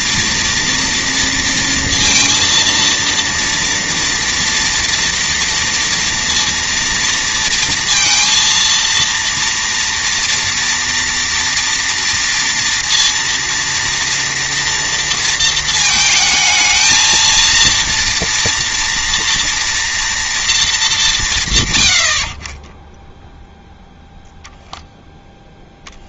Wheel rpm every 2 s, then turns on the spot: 230, 230, 230, 230, 230, 230, 230, 230, 220, 230, 220, 20, 0.
none